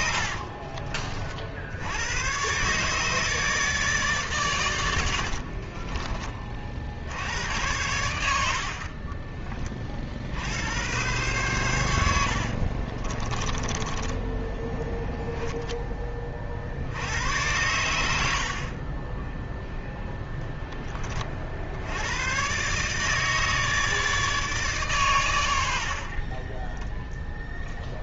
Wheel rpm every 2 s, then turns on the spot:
50, 130, 120, 50, 60, 80, 60, 10, 50, 50, 10, 130, 140, 20.
0-2 12-16